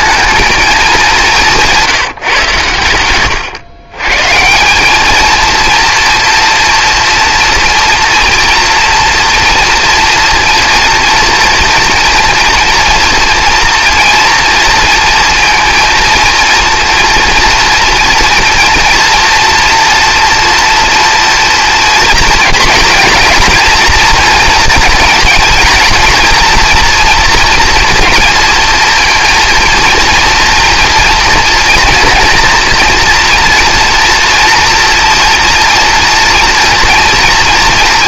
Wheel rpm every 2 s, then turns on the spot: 220, 130, 160, 230, 240, 230, 230, 230, 230, 230, 230, 230, 230, 230, 230, 230, 230, 240, 230.
none